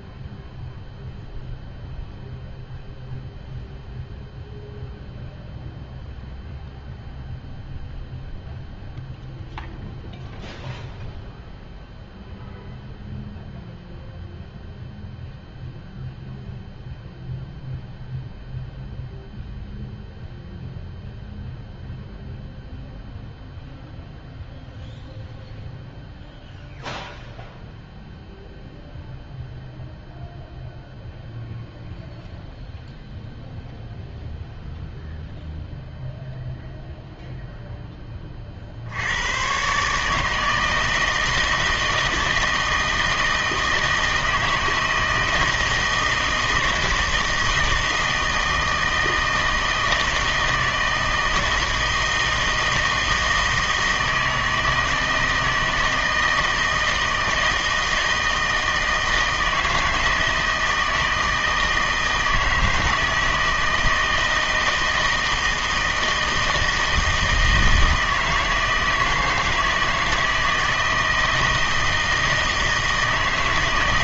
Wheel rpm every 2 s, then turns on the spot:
0, 0, 0, 0, 0, 0, 0, 0, 0, 0, 0, 0, 0, 0, 0, 0, 0, 0, 0, 60, 160, 160, 160, 160, 160, 160, 160, 160, 160, 160, 160, 160, 160, 160, 160, 160, 160.
none